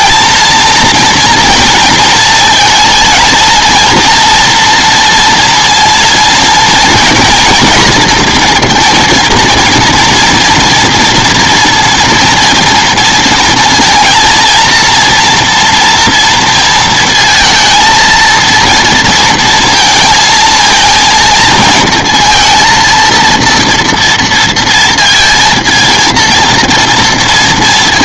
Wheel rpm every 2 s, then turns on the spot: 230, 230, 230, 230, 240, 230, 230, 230, 230, 230, 230, 230, 230, 230.
none